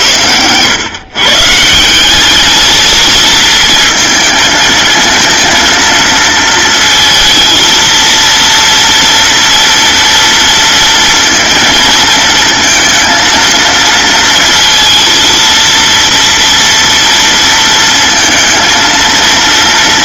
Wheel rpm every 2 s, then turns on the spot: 110, 210, 220, 230, 230, 230, 230, 230, 230, 230.
none